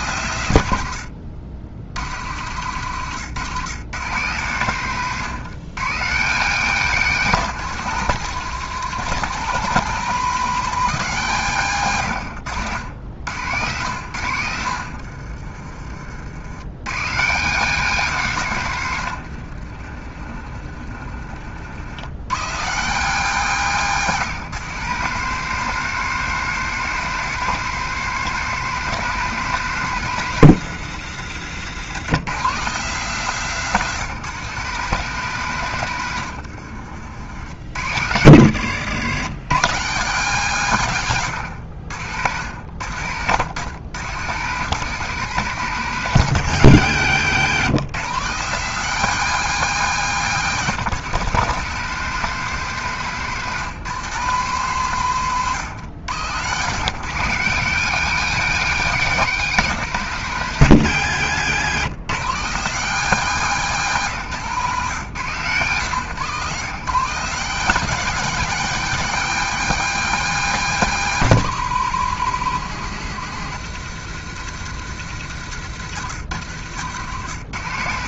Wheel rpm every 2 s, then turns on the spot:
100, 110, 130, 150, 170, 180, 80, 60, 110, 120, 40, 150, 160, 190, 190, 140, 160, 170, 60, 110, 130, 90, 160, 130, 180, 160, 170, 150, 140, 190, 140, 160, 130, 140, 190, 180, 140, 130, 110.
6-8 14-16 20-22 64-66